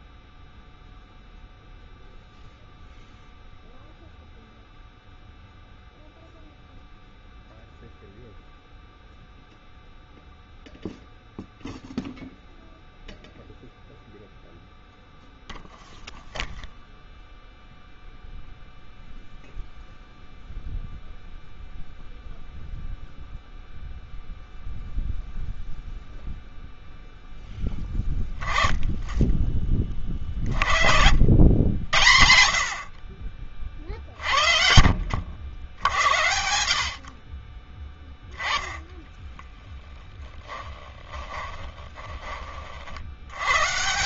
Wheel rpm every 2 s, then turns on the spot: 0, 0, 0, 0, 0, 0, 0, 0, 0, 0, 0, 0, 0, 0, 10, 50, 60, 60, 70, 10, 10, 40.
38-42